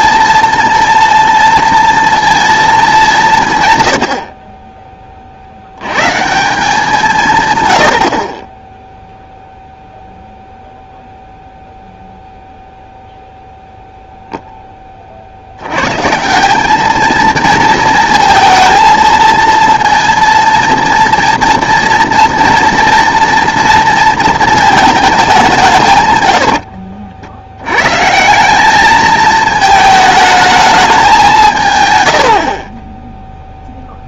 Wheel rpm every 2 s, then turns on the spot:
230, 210, 30, 170, 0, 0, 0, 20, 210, 230, 240, 230, 220, 60, 210, 200, 10.
26-28